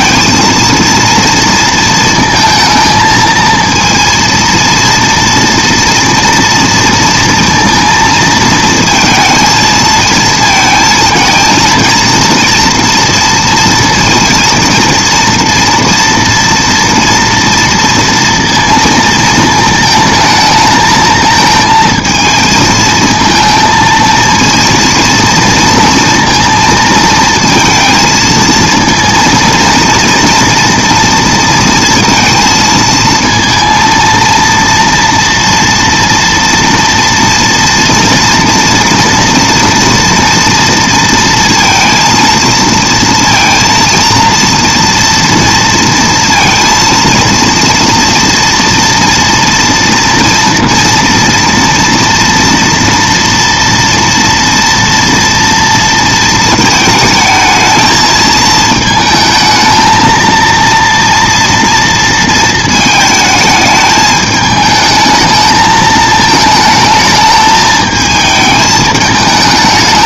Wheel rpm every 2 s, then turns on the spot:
230, 230, 230, 230, 230, 220, 230, 230, 230, 230, 220, 220, 230, 230, 230, 240, 230, 230, 230, 230, 230, 230, 230, 230, 230, 230, 230, 230, 220, 220, 230, 220, 210, 220, 220.
none